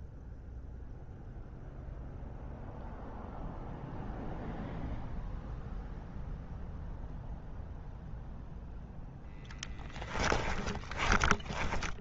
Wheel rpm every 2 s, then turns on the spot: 0, 0, 0, 0, 0, 10.
10-12